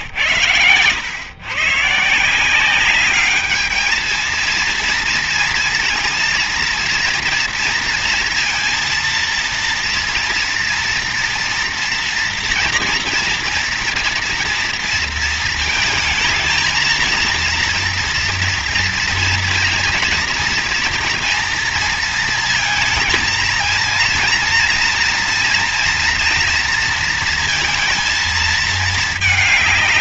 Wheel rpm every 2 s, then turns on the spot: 120, 170, 220, 230, 230, 230, 230, 230, 220, 230, 230, 230, 230, 230, 220.
none